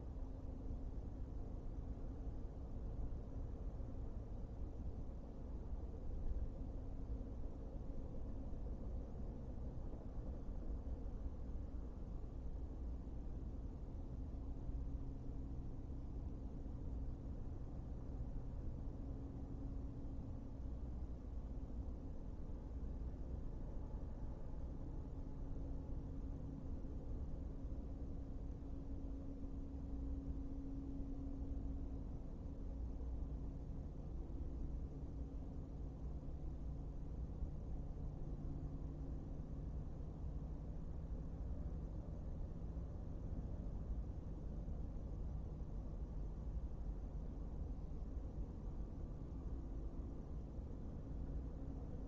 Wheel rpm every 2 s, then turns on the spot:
0, 0, 0, 0, 0, 0, 0, 0, 0, 0, 0, 0, 0, 0, 0, 0, 0, 0, 0, 0, 0, 0, 0, 0, 0, 0.
none